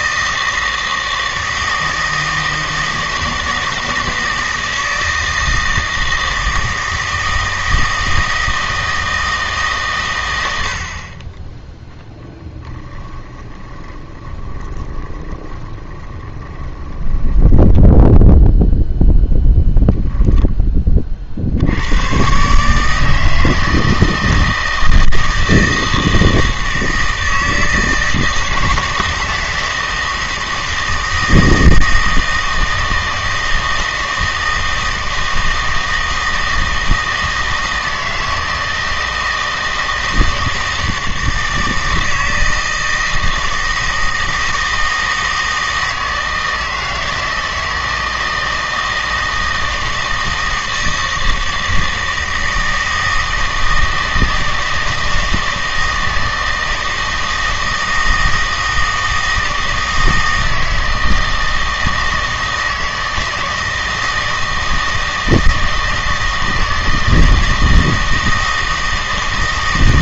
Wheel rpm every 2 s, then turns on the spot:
160, 160, 160, 160, 160, 80, 10, 20, 20, 0, 20, 140, 160, 160, 160, 160, 160, 160, 160, 160, 160, 160, 160, 160, 160, 160, 160, 160, 160, 160, 160, 160, 160, 160, 160.
12-18